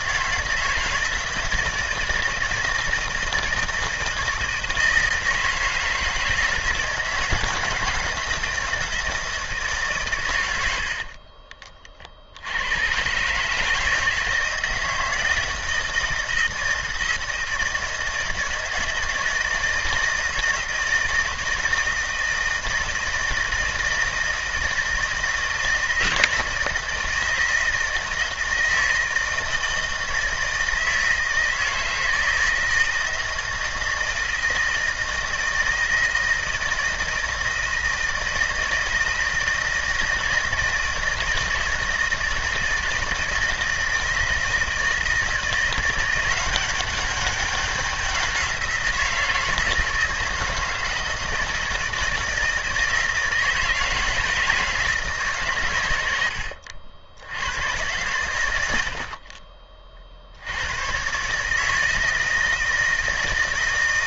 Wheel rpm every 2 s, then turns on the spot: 160, 160, 160, 160, 170, 60, 110, 160, 160, 160, 160, 160, 160, 160, 160, 160, 160, 170, 160, 160, 160, 160, 160, 200, 170, 160, 160, 160, 80, 70, 120, 160.
none